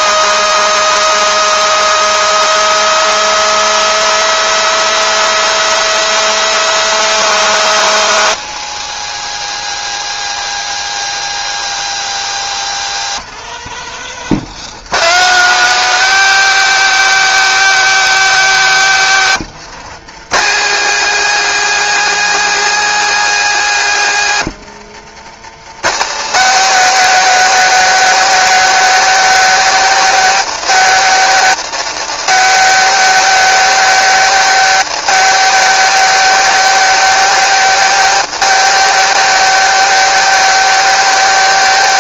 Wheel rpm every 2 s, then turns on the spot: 210, 200, 210, 210, 230, 230, 200, 200, 220, 190, 230, 230, 160, 220, 220, 230, 220, 230, 230, 230, 220.
none